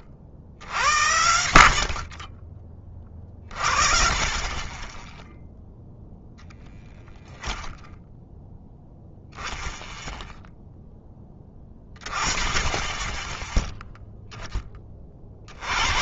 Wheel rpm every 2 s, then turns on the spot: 60, 30, 20, 0, 0, 10, 20, 20.
none